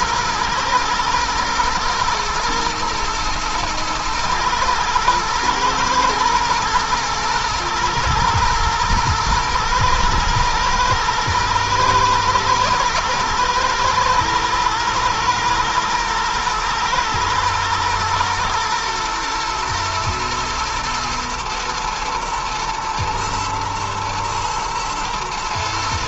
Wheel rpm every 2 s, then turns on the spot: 120, 110, 120, 120, 110, 110, 110, 120, 110, 120, 120, 120, 120.
none